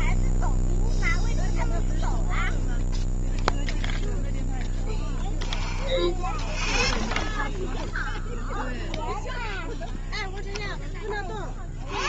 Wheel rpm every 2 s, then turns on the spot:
0, 0, 0, 10, 0, 10.
6-8